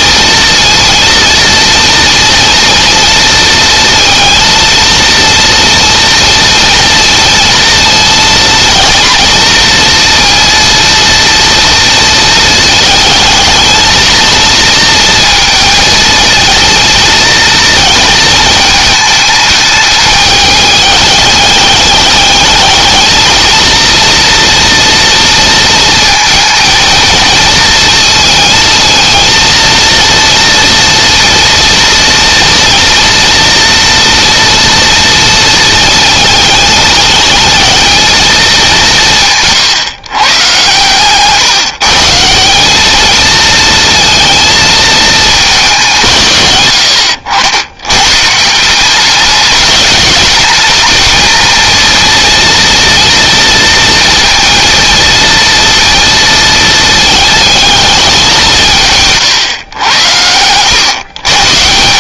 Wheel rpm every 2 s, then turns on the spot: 230, 230, 230, 230, 230, 230, 220, 230, 230, 220, 210, 220, 230, 230, 220, 230, 230, 230, 210, 190, 140, 210, 230, 100, 180, 220, 230, 230, 220, 160, 110.
none